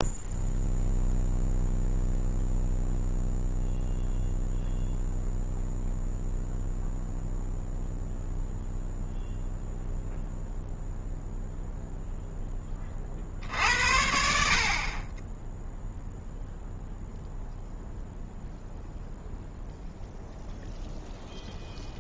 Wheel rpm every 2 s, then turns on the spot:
0, 0, 0, 0, 0, 0, 30, 40, 0, 0, 0.
none